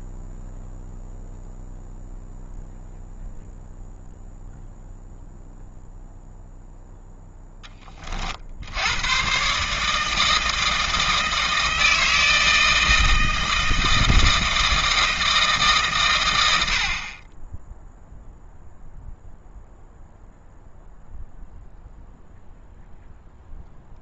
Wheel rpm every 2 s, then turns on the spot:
0, 0, 0, 0, 90, 160, 160, 160, 60, 0, 0, 0.
none